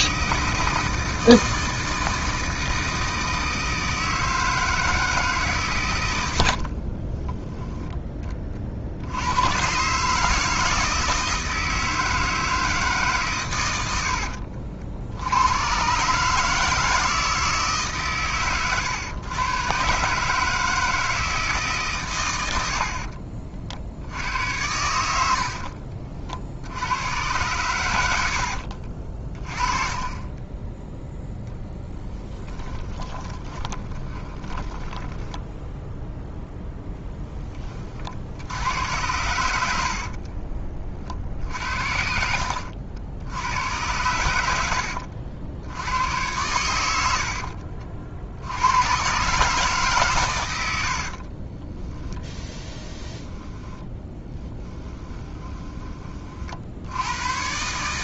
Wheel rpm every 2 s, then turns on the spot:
160, 160, 160, 70, 50, 160, 160, 70, 160, 130, 160, 80, 90, 70, 70, 20, 30, 20, 0, 80, 40, 70, 80, 70, 90, 80, 10, 10, 60.
6-8 22-24 28-30 32-36 50-52 54-56